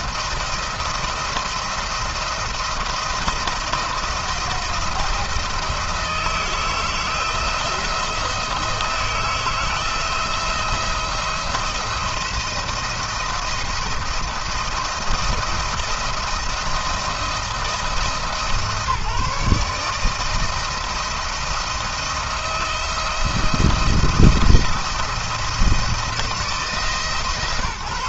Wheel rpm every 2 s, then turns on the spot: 170, 170, 170, 160, 160, 170, 170, 170, 160, 160, 160, 170, 170, 160.
none